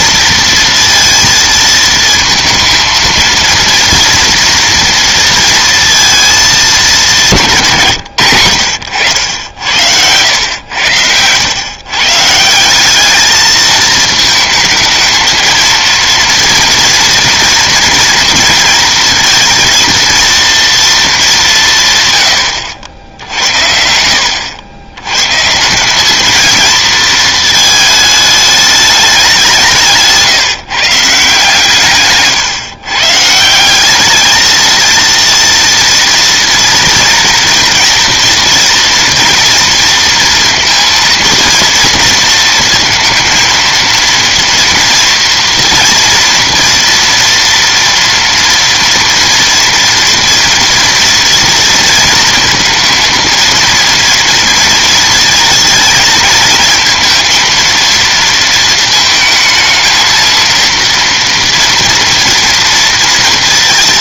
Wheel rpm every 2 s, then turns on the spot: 230, 230, 230, 180, 90, 110, 220, 230, 240, 230, 180, 80, 130, 220, 190, 150, 160, 230, 230, 230, 230, 230, 230, 230, 230, 230, 230, 230, 230, 220, 240, 230.
none